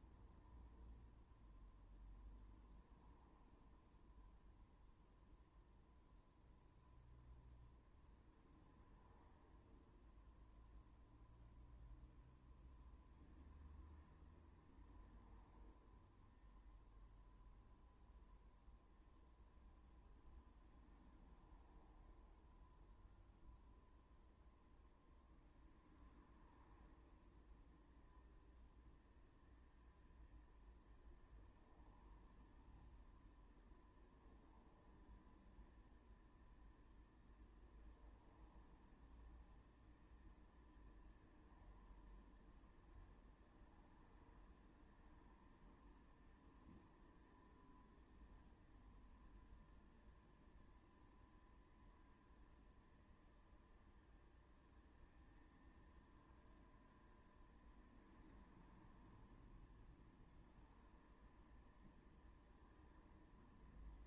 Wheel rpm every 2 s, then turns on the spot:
0, 0, 0, 0, 0, 0, 0, 0, 0, 0, 0, 0, 0, 0, 0, 0, 0, 0, 0, 0, 0, 0, 0, 0, 0, 0, 0, 0, 0, 0, 0, 0.
none